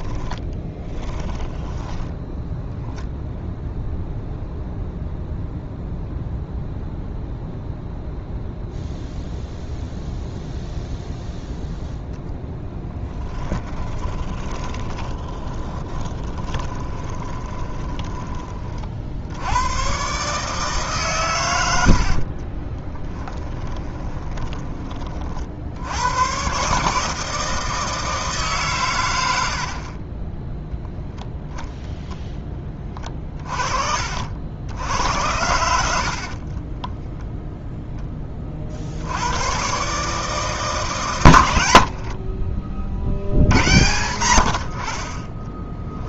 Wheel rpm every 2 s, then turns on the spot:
20, 0, 0, 0, 0, 0, 0, 20, 20, 40, 140, 20, 20, 140, 120, 0, 20, 80, 40, 50, 150, 50, 60.
0-2 14-18 22-24 32-34 36-38